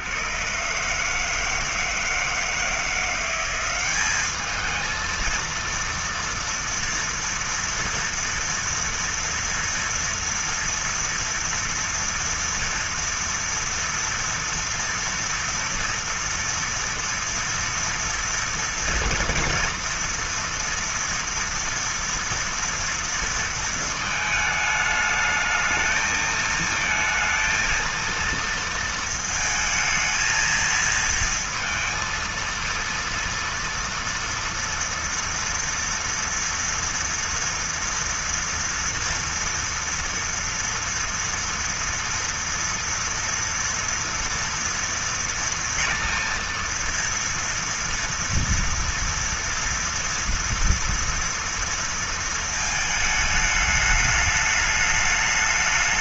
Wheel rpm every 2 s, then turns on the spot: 140, 160, 220, 230, 230, 230, 230, 230, 230, 230, 230, 230, 210, 220, 230, 230, 230, 230, 230, 240, 230, 240, 230, 230, 230, 230, 220, 210.
none